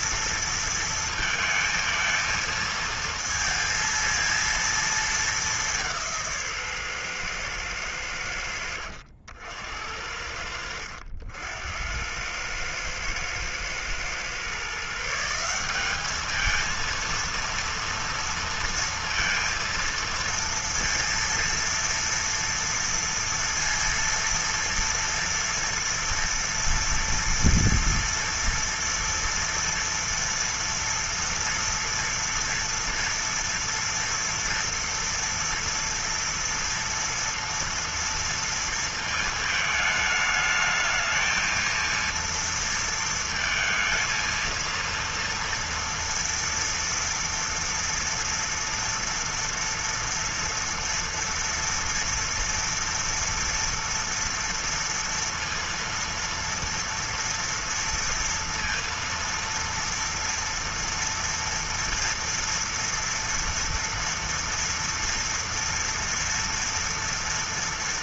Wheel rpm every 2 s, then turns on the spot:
230, 230, 230, 180, 100, 70, 90, 120, 210, 230, 230, 230, 230, 230, 230, 230, 230, 230, 240, 230, 220, 230, 230, 230, 230, 230, 230, 230, 230, 230, 230, 230, 240, 230.
none